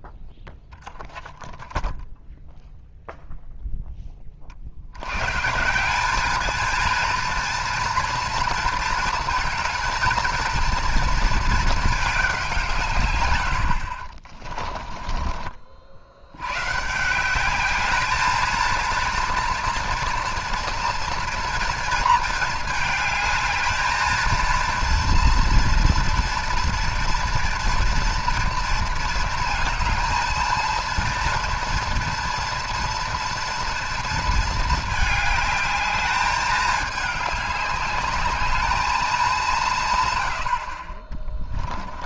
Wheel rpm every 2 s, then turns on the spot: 0, 0, 60, 220, 230, 230, 170, 20, 130, 230, 230, 220, 230, 230, 230, 230, 230, 220, 210, 210, 60.
14-16